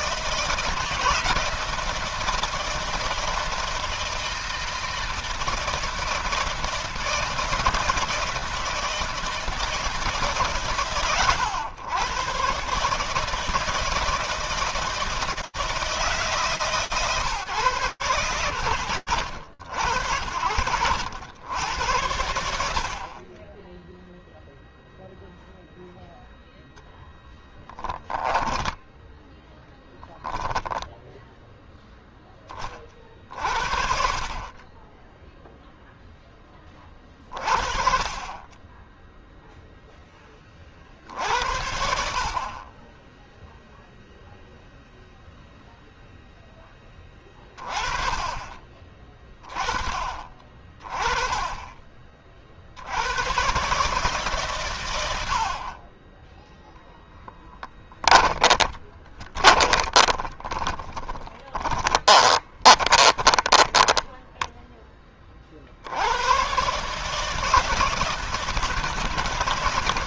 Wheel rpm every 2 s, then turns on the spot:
160, 160, 160, 160, 160, 120, 160, 160, 120, 90, 90, 20, 0, 0, 0, 0, 50, 0, 30, 0, 60, 0, 0, 20, 20, 20, 110, 80, 10, 30, 20, 20, 20, 150, 160.
56-64